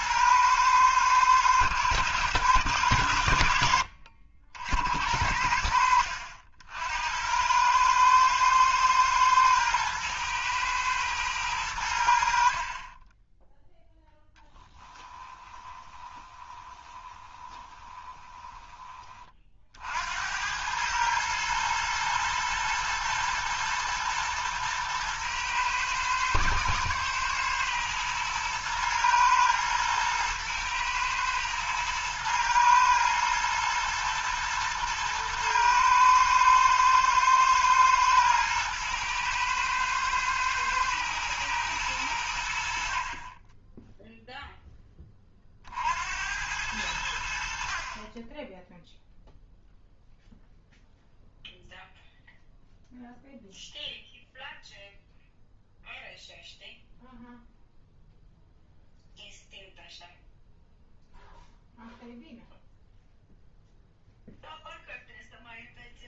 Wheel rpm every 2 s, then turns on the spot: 110, 100, 70, 70, 110, 110, 50, 10, 20, 20, 100, 110, 110, 110, 110, 110, 120, 120, 110, 110, 110, 70, 10, 90, 10, 0, 0, 0, 0, 0, 0, 0, 0.
14-18